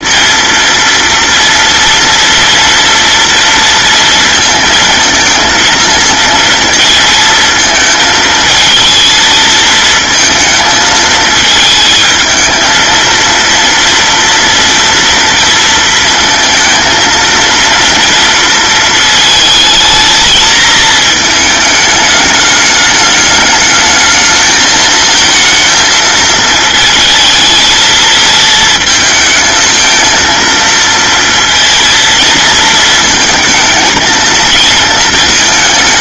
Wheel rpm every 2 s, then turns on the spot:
230, 230, 230, 230, 230, 230, 220, 230, 230, 230, 220, 210, 220, 220, 220, 230, 230, 220.
none